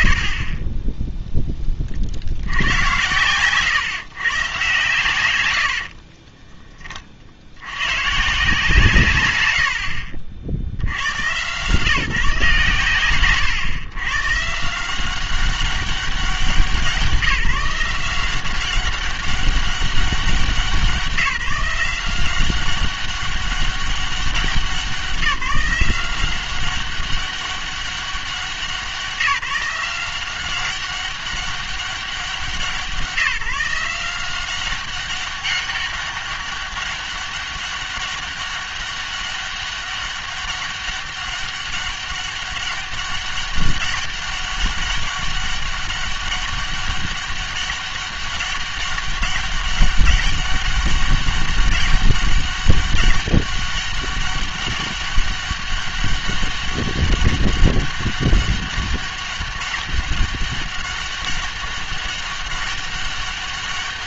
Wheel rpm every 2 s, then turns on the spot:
50, 90, 150, 20, 160, 80, 130, 150, 180, 190, 180, 190, 190, 190, 190, 190, 170, 190, 200, 200, 200, 200, 200, 200, 200, 200, 200, 200, 200, 200, 200, 200.
none